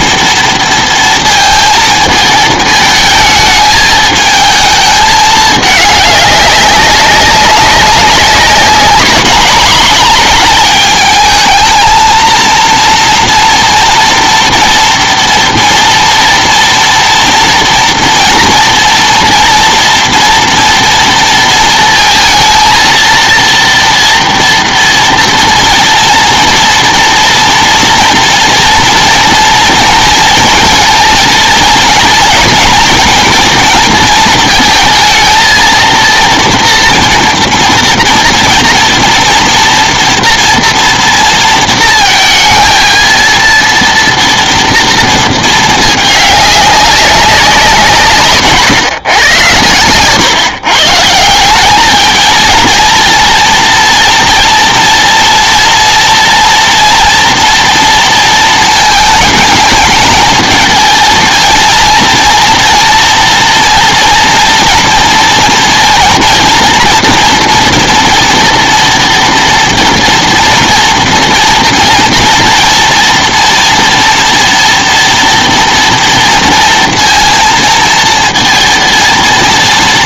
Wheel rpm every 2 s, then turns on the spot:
230, 220, 220, 200, 200, 210, 230, 230, 230, 230, 230, 230, 230, 230, 230, 230, 220, 230, 230, 230, 230, 230, 230, 200, 140, 130, 230, 230, 230, 230, 220, 230, 230, 230, 230, 230, 230, 230, 230, 230.
none